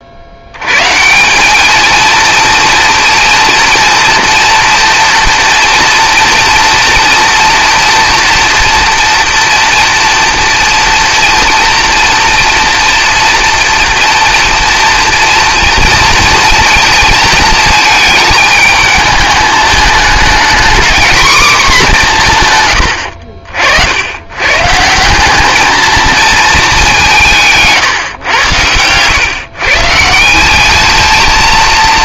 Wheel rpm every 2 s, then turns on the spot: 120, 230, 240, 230, 230, 230, 230, 230, 230, 220, 240, 120, 150, 210, 100, 200.
28-30